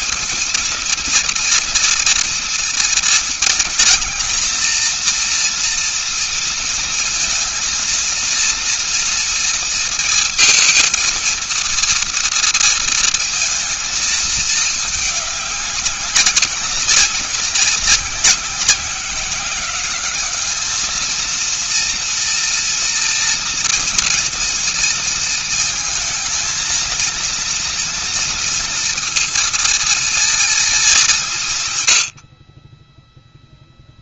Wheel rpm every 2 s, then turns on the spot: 230, 230, 230, 230, 230, 230, 230, 220, 200, 190, 210, 230, 230, 220, 230, 220, 50.
none